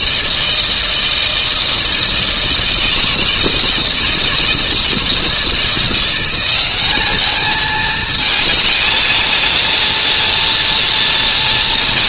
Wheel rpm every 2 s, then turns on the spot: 160, 160, 160, 190, 220, 230.
none